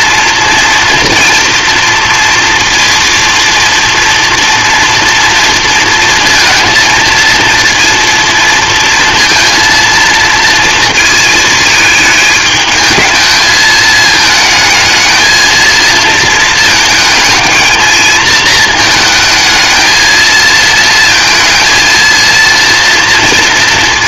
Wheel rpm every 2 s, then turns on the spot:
230, 230, 240, 230, 230, 220, 220, 220, 220, 220, 220, 230.
none